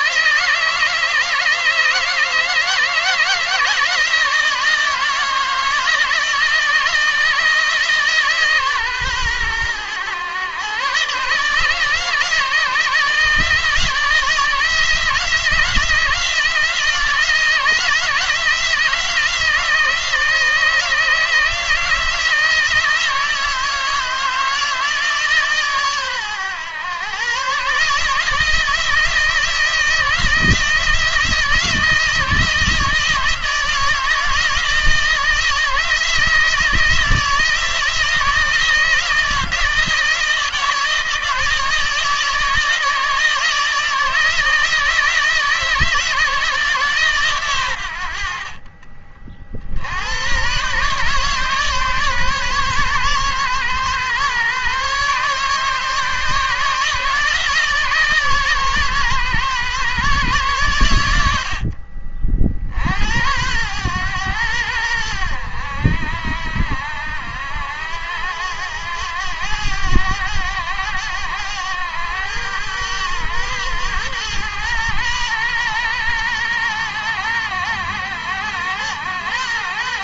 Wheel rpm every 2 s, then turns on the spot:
160, 160, 160, 160, 140, 130, 160, 160, 170, 170, 160, 160, 160, 120, 160, 160, 160, 160, 160, 170, 160, 160, 160, 160, 50, 130, 140, 130, 150, 140, 120, 60, 100, 80, 100, 100, 110, 110, 100, 110.
48-50